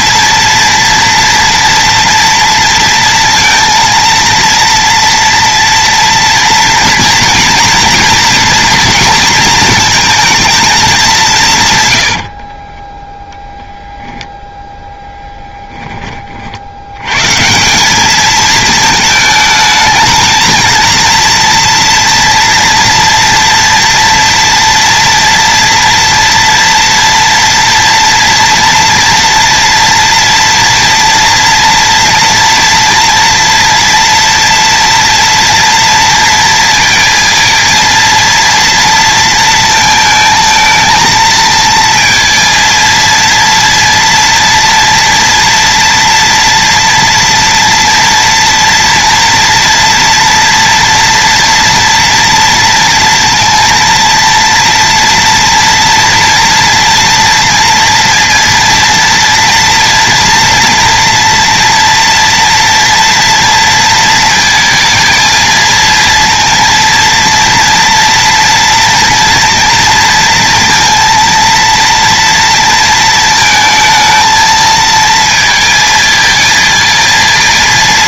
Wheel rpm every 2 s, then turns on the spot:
230, 230, 230, 230, 230, 220, 20, 0, 90, 220, 230, 230, 240, 230, 230, 230, 230, 230, 230, 230, 220, 230, 230, 230, 240, 230, 230, 230, 230, 230, 230, 230, 220, 230, 230, 230, 230, 220, 220.
12-14